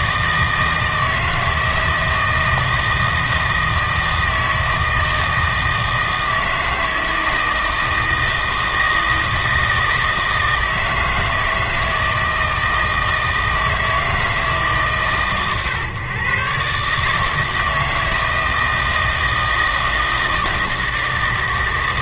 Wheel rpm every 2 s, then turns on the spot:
160, 160, 160, 160, 160, 160, 160, 150, 140, 160, 160.
none